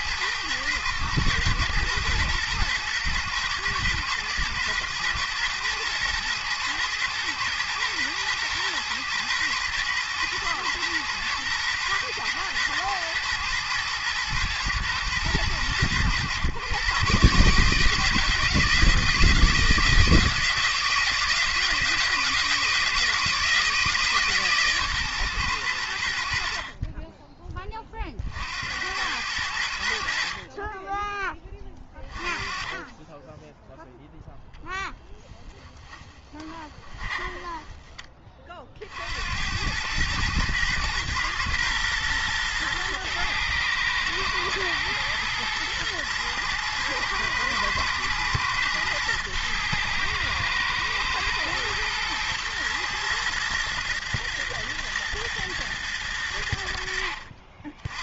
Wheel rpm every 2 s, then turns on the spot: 110, 110, 110, 110, 120, 120, 120, 120, 130, 160, 160, 160, 140, 50, 70, 30, 20, 10, 20, 40, 110, 120, 110, 110, 120, 110, 110, 110, 80.
36-38